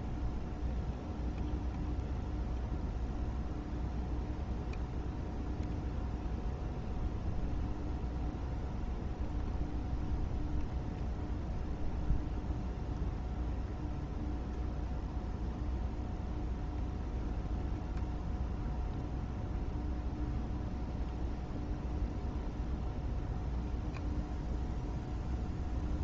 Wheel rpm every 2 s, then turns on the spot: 0, 0, 0, 0, 0, 0, 0, 0, 0, 0, 0, 0, 0.
none